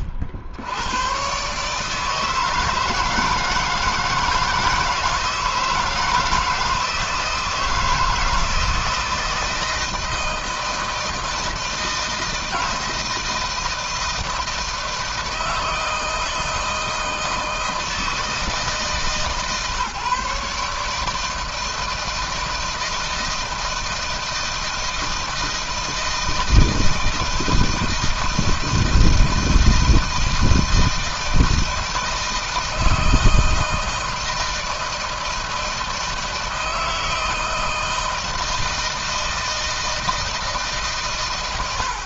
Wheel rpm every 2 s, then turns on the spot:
90, 160, 160, 160, 160, 160, 160, 160, 160, 150, 140, 160, 160, 160, 160, 160, 160, 160, 160, 160, 150.
none